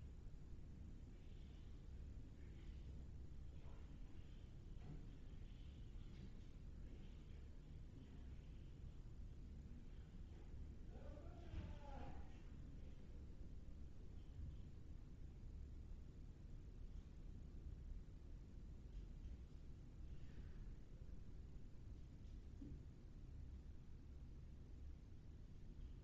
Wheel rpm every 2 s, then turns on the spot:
0, 0, 0, 0, 0, 0, 0, 0, 0, 0, 0, 0, 0.
none